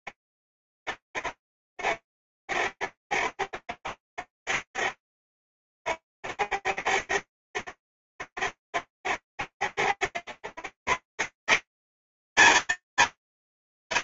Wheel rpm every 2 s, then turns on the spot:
90, 90, 90, 90, 90, 90, 190.
none